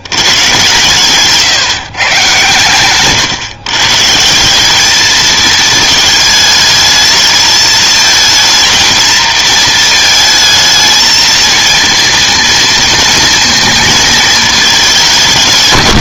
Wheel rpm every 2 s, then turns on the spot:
130, 130, 190, 220, 230, 220, 230, 210.
none